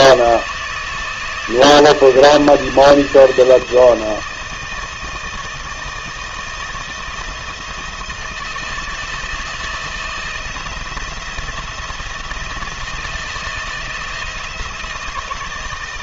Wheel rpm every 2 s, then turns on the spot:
160, 160, 160, 160, 160, 170, 160, 160.
none